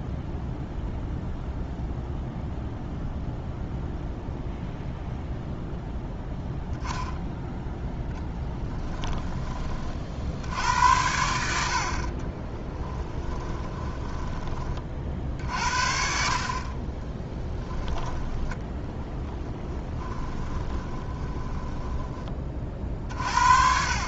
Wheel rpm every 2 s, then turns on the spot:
0, 0, 0, 0, 10, 80, 10, 40, 30, 10, 30, 40.
8-10 12-14 18-22